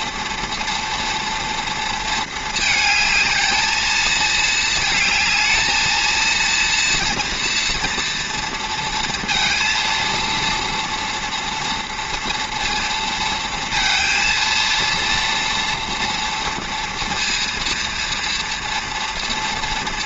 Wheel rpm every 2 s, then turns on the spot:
230, 220, 220, 230, 230, 230, 230, 230, 230, 230.
none